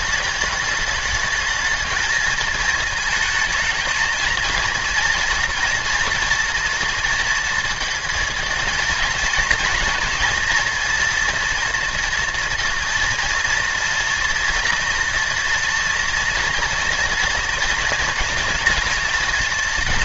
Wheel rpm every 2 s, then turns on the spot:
210, 220, 230, 230, 230, 230, 230, 230, 240, 230.
none